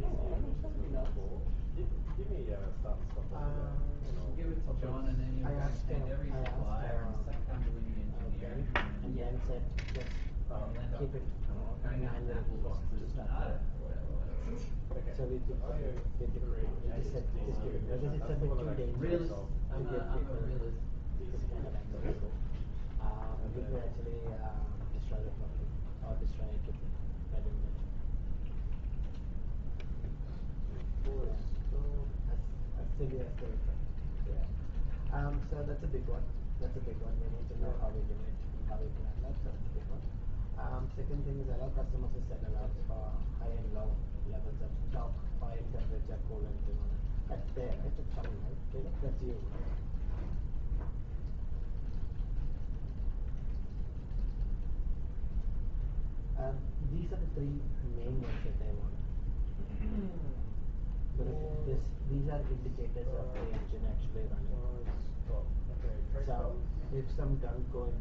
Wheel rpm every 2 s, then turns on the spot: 0, 0, 0, 0, 0, 0, 0, 0, 0, 0, 0, 0, 0, 0, 0, 0, 0, 0, 0, 0, 0, 0, 0, 0, 0, 0, 0, 0, 0, 0, 0, 0, 0, 0.
none